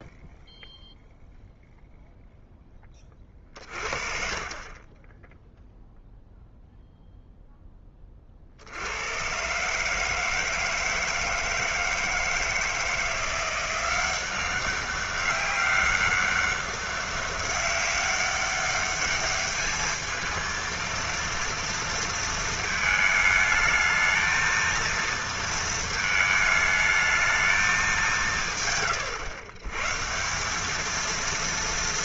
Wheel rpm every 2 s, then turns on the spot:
0, 0, 40, 0, 50, 160, 160, 190, 200, 200, 230, 220, 220, 220, 130, 190.
none